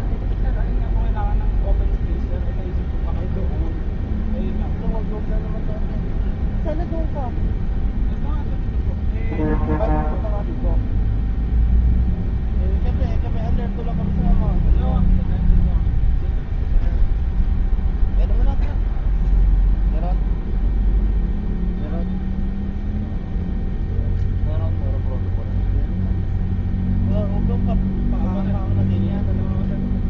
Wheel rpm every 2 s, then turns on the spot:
0, 0, 0, 0, 0, 0, 0, 0, 0, 0, 0, 0, 0, 0, 0.
none